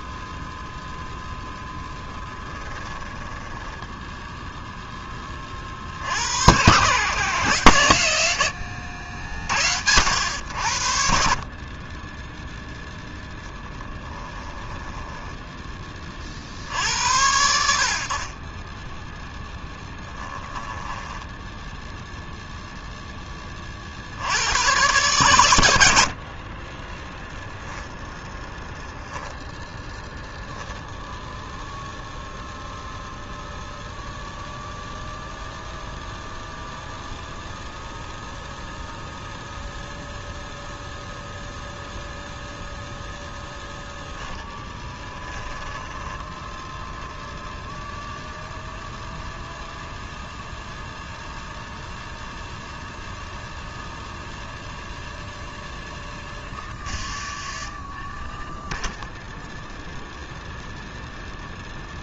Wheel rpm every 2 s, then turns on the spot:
0, 10, 0, 90, 100, 80, 0, 10, 60, 20, 10, 0, 110, 30, 0, 0, 0, 0, 0, 0, 0, 0, 10, 10, 0, 0, 0, 0, 20, 0, 0.
2-4 14-16 20-22 44-46 56-58